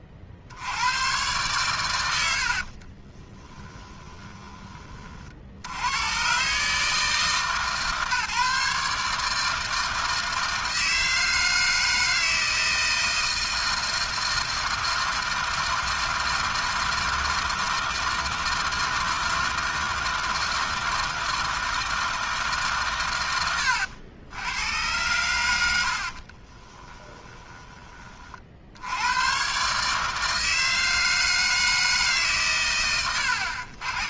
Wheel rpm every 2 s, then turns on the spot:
90, 40, 60, 150, 150, 160, 160, 160, 160, 160, 160, 120, 90, 20, 70, 160, 110.
2-4 26-28 32-34